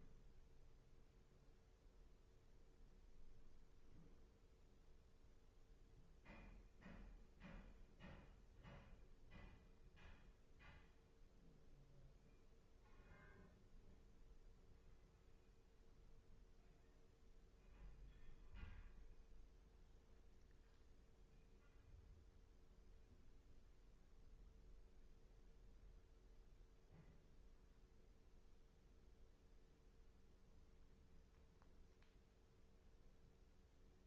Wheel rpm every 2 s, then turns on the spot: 0, 0, 0, 0, 0, 0, 0, 0, 0, 0, 0, 0, 0, 0, 0, 0, 0.
none